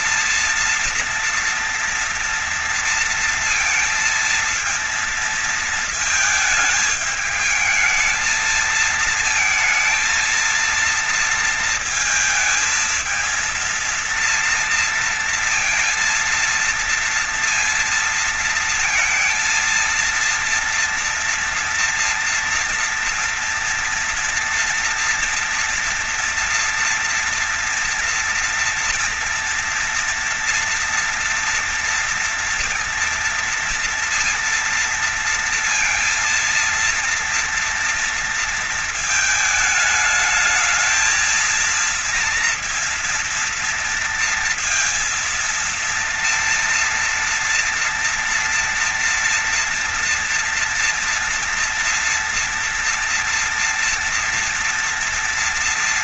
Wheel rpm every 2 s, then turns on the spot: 230, 230, 230, 220, 220, 230, 220, 230, 230, 230, 230, 240, 240, 230, 230, 230, 230, 230, 230, 220, 220, 230, 230, 230, 230, 230, 230, 230.
none